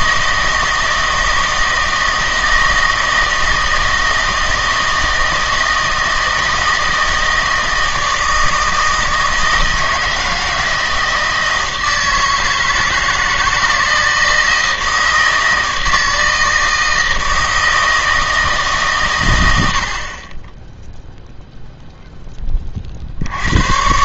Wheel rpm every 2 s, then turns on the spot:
160, 160, 160, 160, 160, 160, 160, 160, 160, 140, 0, 40.
none